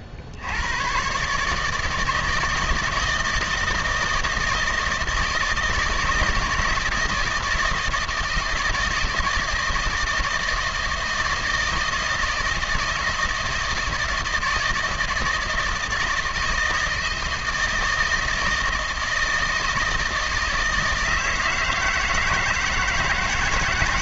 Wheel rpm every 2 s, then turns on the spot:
80, 160, 160, 160, 160, 160, 160, 160, 160, 160, 160, 160.
none